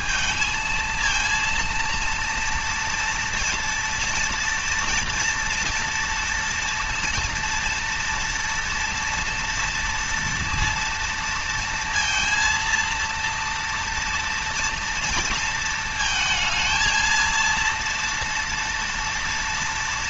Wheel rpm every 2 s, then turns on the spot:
230, 230, 240, 230, 240, 230, 230, 230, 230, 230.
none